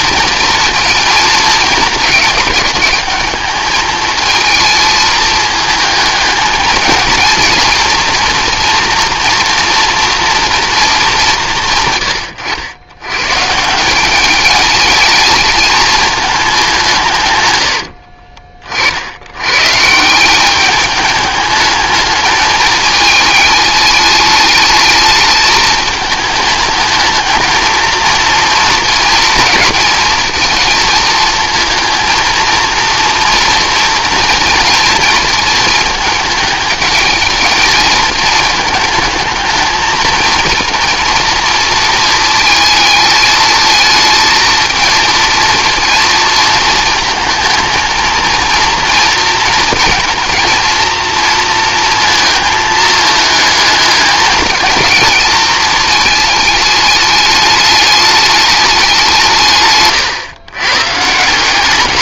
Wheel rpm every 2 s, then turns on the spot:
230, 200, 220, 220, 240, 230, 100, 220, 180, 40, 210, 220, 210, 220, 230, 230, 230, 220, 220, 220, 230, 220, 230, 230, 230, 220, 220, 220, 220, 200, 130.
none